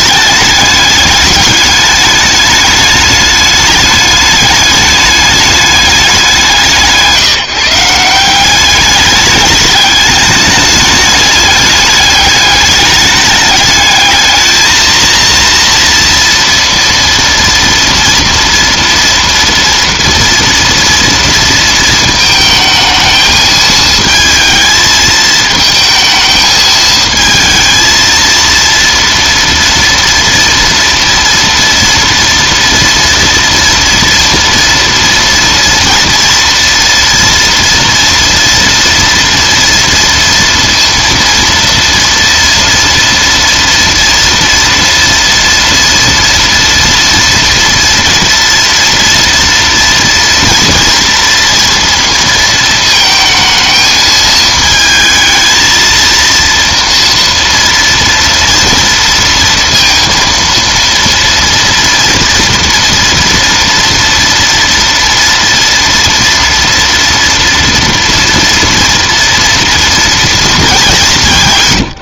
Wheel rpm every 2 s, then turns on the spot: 210, 210, 210, 150, 200, 210, 210, 230, 230, 230, 230, 220, 220, 220, 230, 230, 230, 230, 230, 230, 230, 230, 230, 230, 230, 230, 220, 220, 230, 230, 230, 230, 230, 230, 230, 190.
none